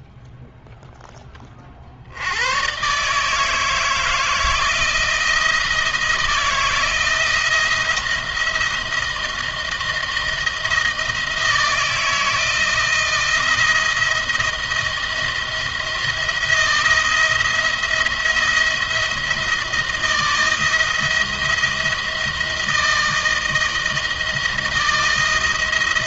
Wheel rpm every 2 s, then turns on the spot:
0, 110, 160, 160, 170, 160, 160, 170, 170, 170, 170, 160, 170.
none